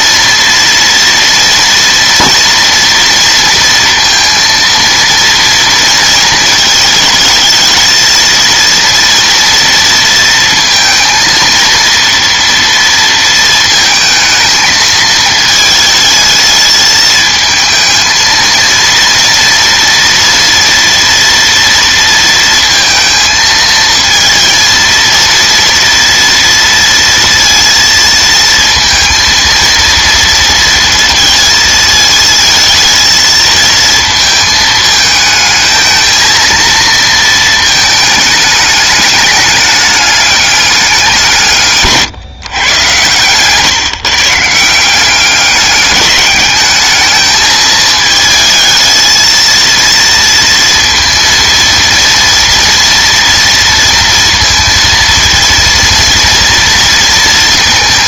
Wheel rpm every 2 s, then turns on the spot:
230, 230, 230, 220, 230, 230, 230, 220, 220, 230, 230, 230, 230, 230, 230, 230, 220, 220, 230, 210, 200, 120, 170, 210, 220, 230, 230, 230, 230.
none